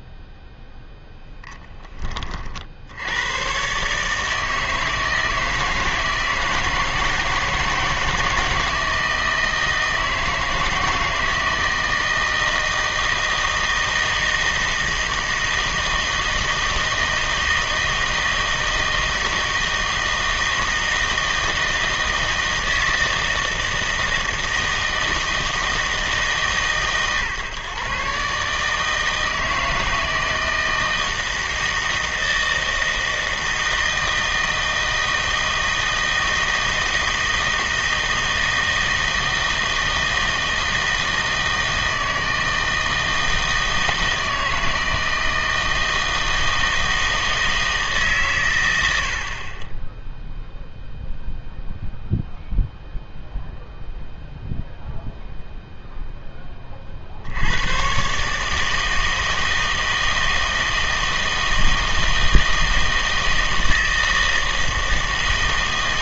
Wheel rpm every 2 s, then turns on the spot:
0, 60, 160, 160, 160, 160, 160, 160, 160, 160, 160, 160, 160, 130, 150, 160, 160, 160, 160, 160, 160, 160, 160, 160, 90, 0, 0, 0, 20, 160, 160, 160, 160.
none